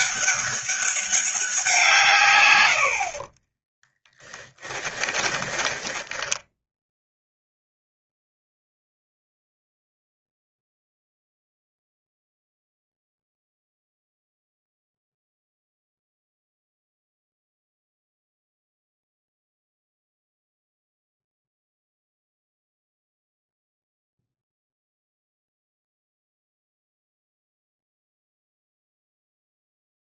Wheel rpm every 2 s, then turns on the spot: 200, 60, 10, 0, 0, 0, 0, 0, 0, 0, 0, 0, 0, 0, 0.
4-6